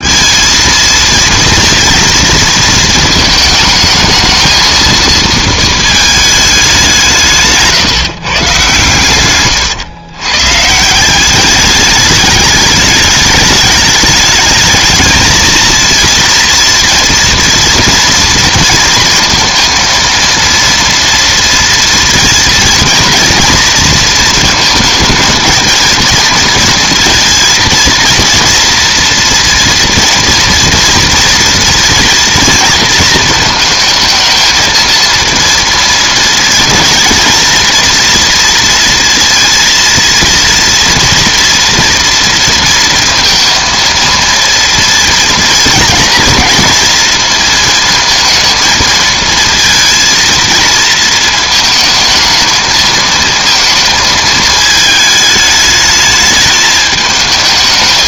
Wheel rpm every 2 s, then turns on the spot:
230, 230, 220, 190, 140, 140, 210, 220, 230, 230, 230, 230, 230, 230, 230, 230, 230, 220, 220, 230, 230, 230, 230, 230, 230, 230, 220, 220, 210.
none